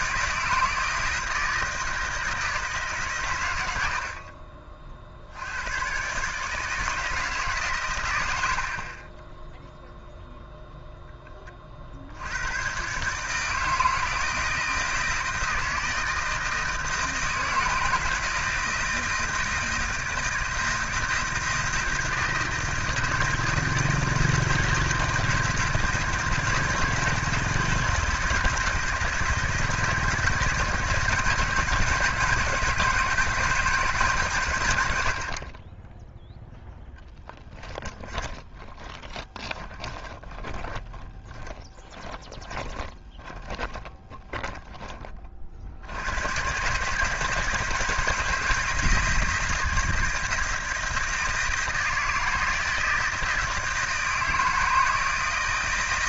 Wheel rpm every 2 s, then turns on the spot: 160, 150, 40, 150, 50, 0, 120, 160, 160, 160, 160, 160, 170, 160, 160, 160, 160, 90, 0, 20, 10, 20, 20, 130, 160, 160, 160, 160.
38-44